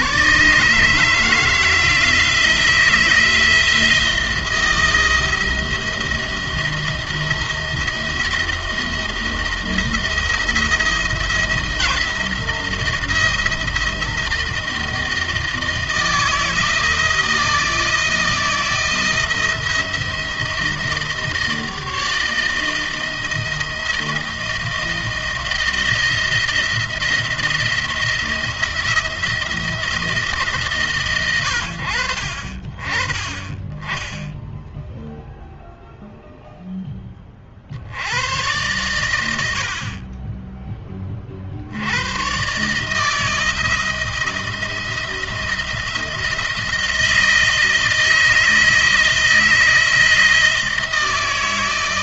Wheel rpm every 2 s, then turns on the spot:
150, 170, 170, 170, 170, 170, 170, 160, 160, 170, 160, 160, 160, 170, 160, 140, 20, 0, 10, 100, 30, 150, 170, 160, 160, 160.
none